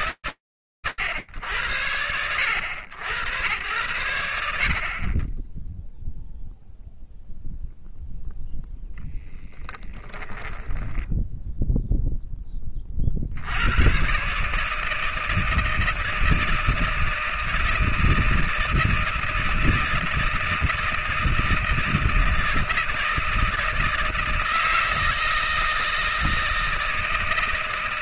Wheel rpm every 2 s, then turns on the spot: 110, 90, 50, 0, 0, 10, 60, 160, 160, 160, 160, 160, 160, 160.
none